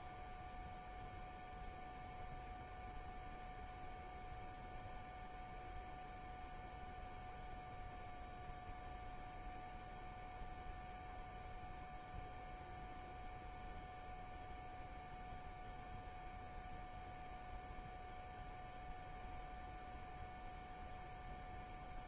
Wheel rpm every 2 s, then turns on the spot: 0, 0, 0, 0, 0, 0, 0, 0, 0, 0, 0.
none